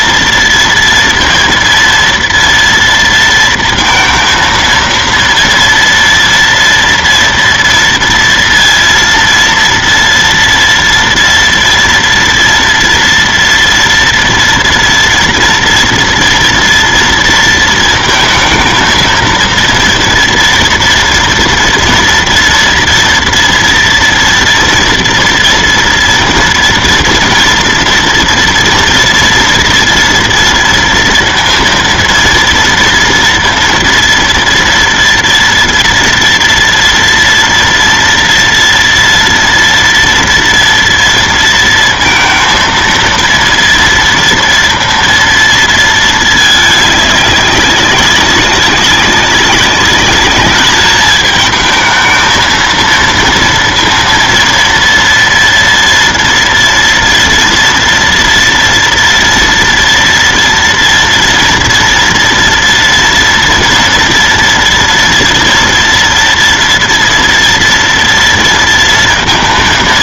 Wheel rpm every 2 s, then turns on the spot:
230, 230, 230, 230, 230, 230, 230, 230, 240, 220, 240, 230, 230, 230, 230, 230, 230, 230, 230, 230, 230, 230, 230, 210, 200, 210, 230, 230, 230, 230, 230, 230, 230, 230, 230.
none